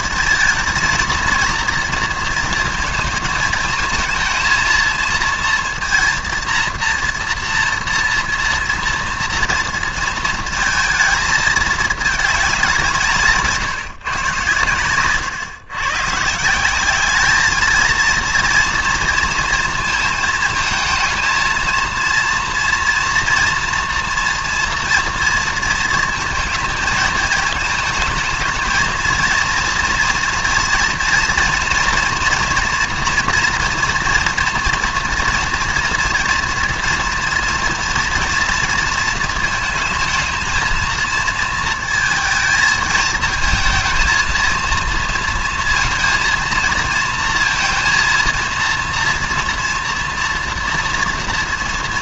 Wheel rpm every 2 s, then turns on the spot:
230, 230, 230, 230, 230, 230, 190, 120, 180, 230, 220, 240, 240, 220, 220, 230, 230, 230, 240, 230, 230, 220, 230, 220, 230, 230.
14-16